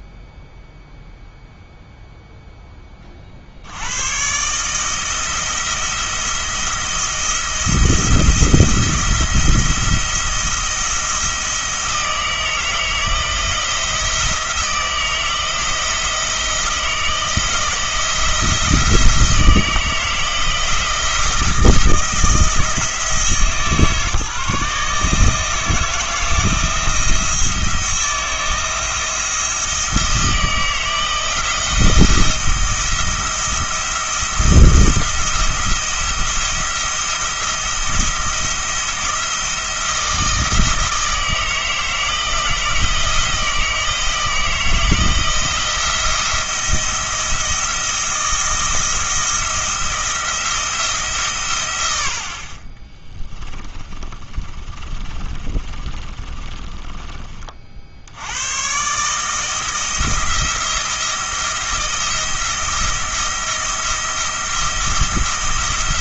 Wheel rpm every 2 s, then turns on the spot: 0, 10, 150, 170, 170, 170, 160, 170, 160, 170, 170, 160, 150, 170, 170, 170, 170, 170, 170, 170, 160, 160, 160, 170, 170, 160, 30, 30, 30, 130, 170, 170, 170.
52-58